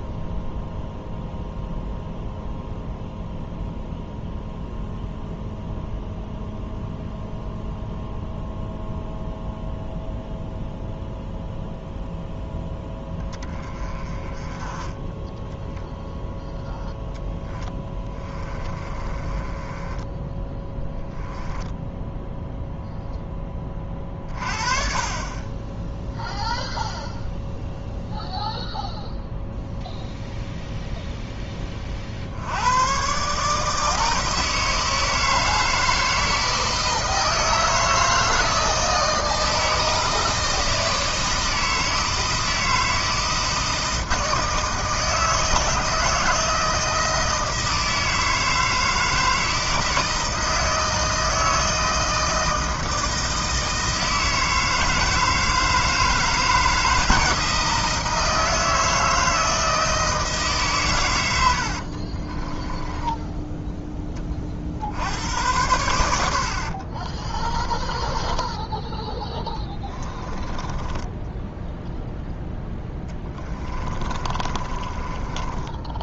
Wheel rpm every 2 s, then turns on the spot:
0, 0, 0, 0, 0, 0, 10, 10, 0, 20, 10, 0, 40, 0, 0, 0, 90, 160, 160, 160, 160, 160, 160, 160, 160, 160, 160, 160, 160, 160, 140, 20, 40, 70, 10, 20, 0, 30.
18-22 66-72 74-76